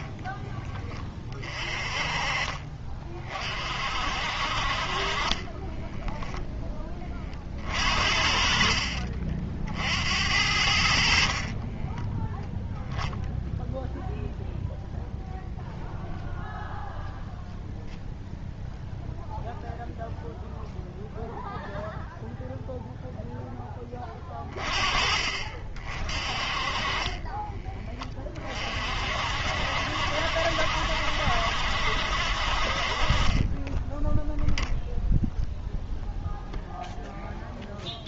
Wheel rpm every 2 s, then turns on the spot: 10, 40, 50, 10, 50, 70, 0, 0, 0, 0, 0, 0, 30, 30, 40, 70, 50, 0, 0.
8-10